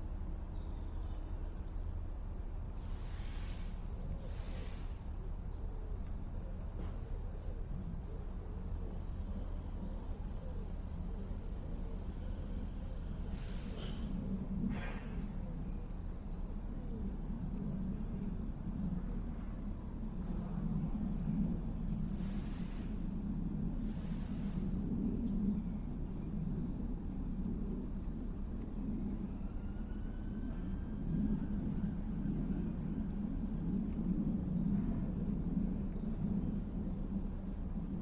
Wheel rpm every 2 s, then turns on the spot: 0, 0, 0, 0, 0, 0, 0, 0, 0, 0, 0, 0, 0, 0, 0, 0, 0, 0, 0.
none